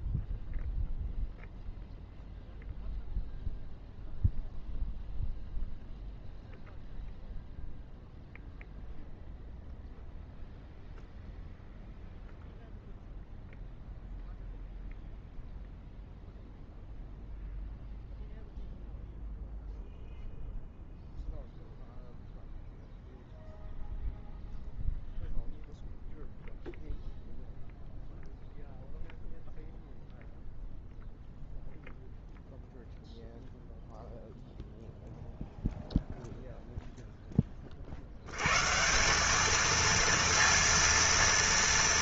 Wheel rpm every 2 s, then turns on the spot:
0, 0, 0, 0, 0, 0, 0, 0, 0, 0, 0, 0, 0, 0, 0, 0, 0, 0, 0, 70, 230.
none